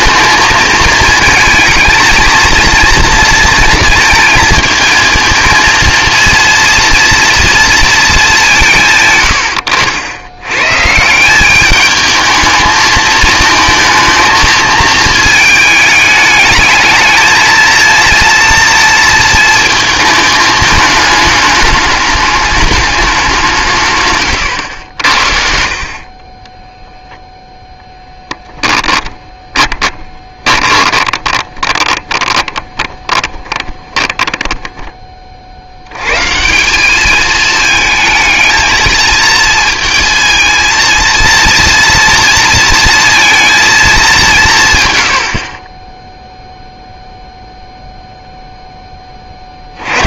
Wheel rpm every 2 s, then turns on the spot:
220, 230, 220, 230, 180, 100, 220, 220, 220, 230, 220, 210, 100, 10, 10, 20, 30, 10, 180, 230, 230, 230, 150, 0, 10.
28-36